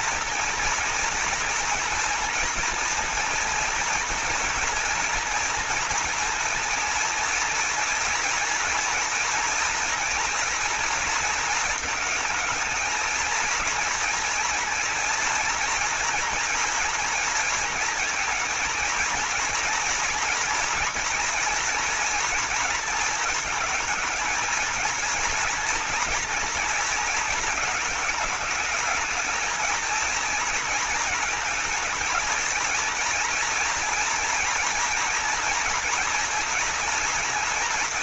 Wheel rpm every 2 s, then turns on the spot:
230, 240, 240, 240, 230, 230, 220, 230, 230, 230, 230, 230, 230, 230, 220, 220, 230, 230, 240.
none